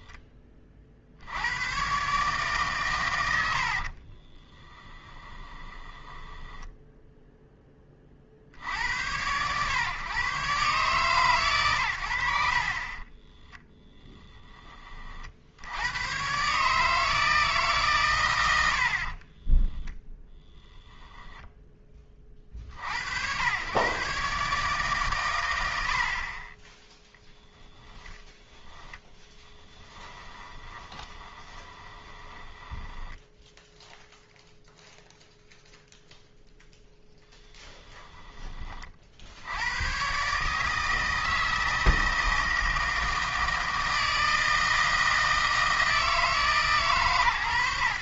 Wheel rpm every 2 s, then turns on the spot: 30, 130, 10, 10, 70, 140, 60, 20, 150, 70, 10, 50, 140, 10, 10, 20, 10, 0, 0, 20, 150, 160, 160, 150.
6-8 20-22 30-34